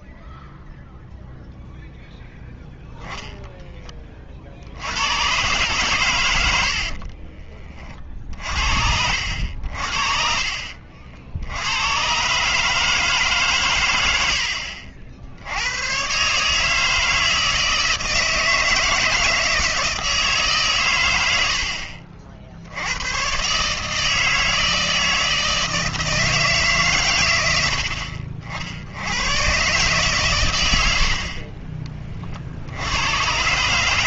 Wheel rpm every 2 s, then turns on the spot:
0, 0, 60, 70, 60, 50, 150, 60, 150, 160, 130, 70, 160, 140, 70, 100, 80.
6-8 10-12